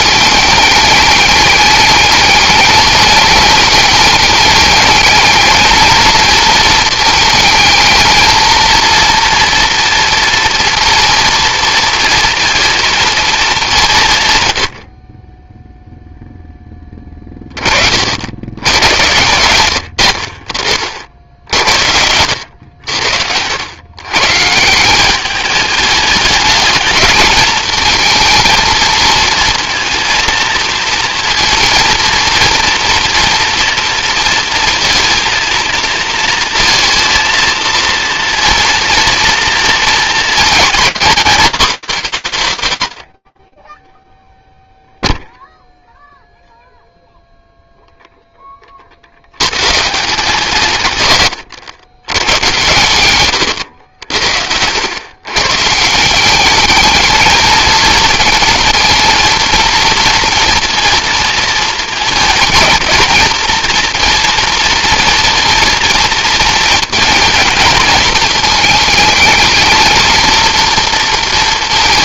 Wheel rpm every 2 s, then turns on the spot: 200, 210, 220, 220, 230, 230, 210, 20, 30, 100, 60, 90, 200, 220, 230, 230, 230, 230, 230, 230, 270, 70, 0, 0, 100, 120, 110, 140, 220, 230, 230, 230, 230, 230, 220, 230.
none